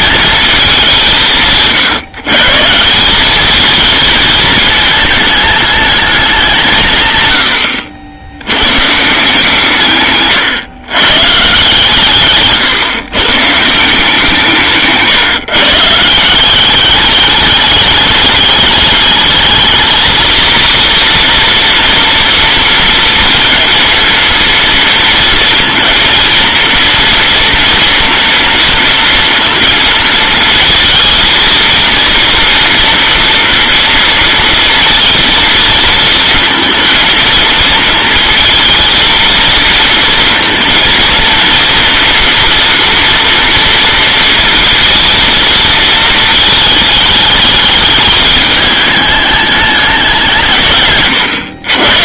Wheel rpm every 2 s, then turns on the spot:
200, 160, 220, 170, 120, 130, 140, 160, 190, 210, 230, 230, 230, 230, 230, 230, 230, 230, 230, 230, 230, 230, 230, 220, 210, 150.
none